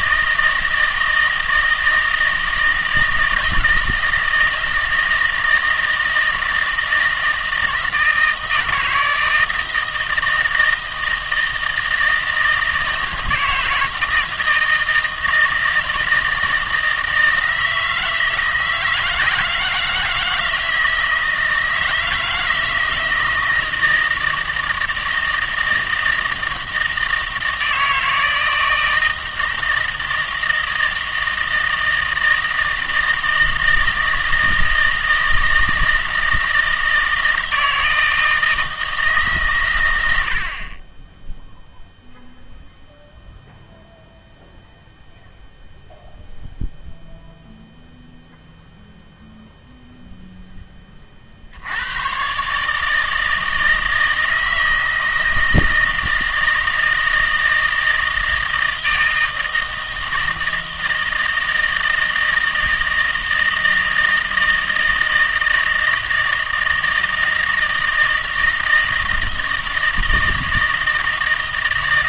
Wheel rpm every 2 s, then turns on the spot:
160, 160, 160, 160, 160, 160, 160, 160, 160, 160, 160, 160, 160, 160, 160, 160, 160, 160, 160, 160, 40, 0, 0, 0, 0, 0, 140, 160, 160, 160, 160, 160, 160, 160, 160, 160.
none